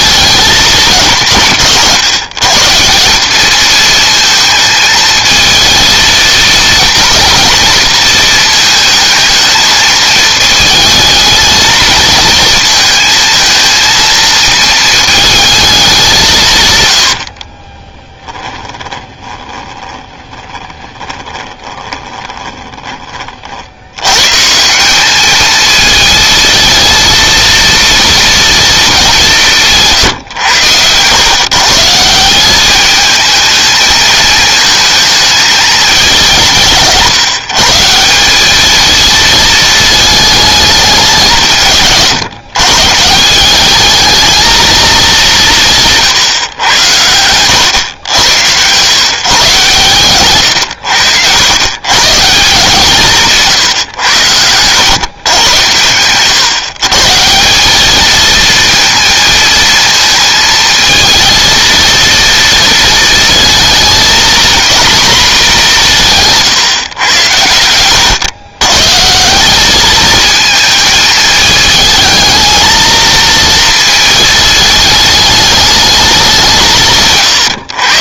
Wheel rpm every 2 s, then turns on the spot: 210, 160, 220, 220, 220, 220, 220, 220, 120, 20, 20, 20, 170, 230, 240, 110, 200, 220, 160, 210, 210, 140, 220, 100, 120, 110, 170, 120, 140, 230, 220, 230, 240, 130, 130, 220, 220, 220, 170.
18-24